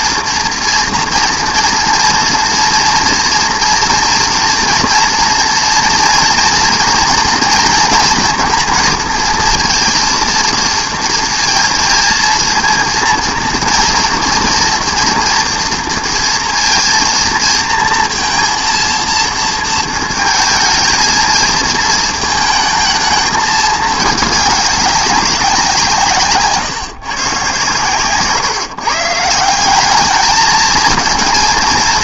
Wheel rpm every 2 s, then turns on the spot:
230, 230, 230, 230, 230, 230, 230, 230, 230, 230, 220, 220, 200, 130, 140, 220.
none